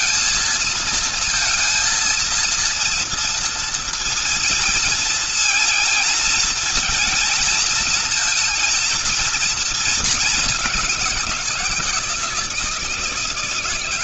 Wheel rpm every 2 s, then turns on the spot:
230, 230, 230, 230, 230, 210, 160.
none